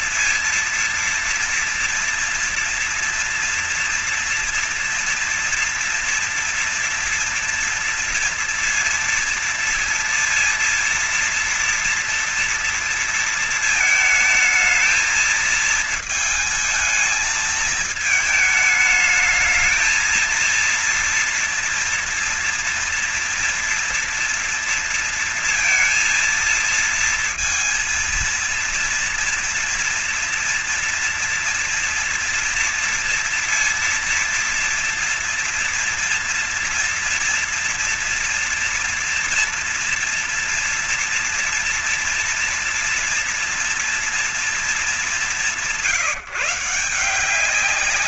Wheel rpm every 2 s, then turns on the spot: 230, 230, 230, 230, 230, 230, 230, 220, 220, 220, 230, 230, 230, 230, 230, 230, 230, 230, 240, 230, 230, 230, 200, 160.
none